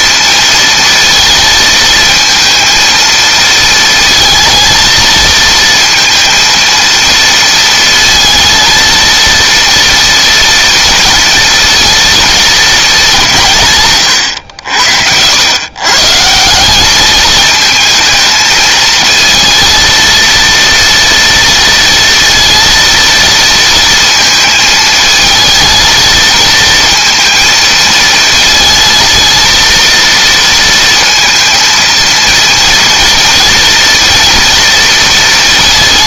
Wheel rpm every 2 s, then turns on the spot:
230, 230, 230, 230, 230, 230, 210, 80, 200, 220, 230, 230, 220, 230, 230, 230, 230, 230.
none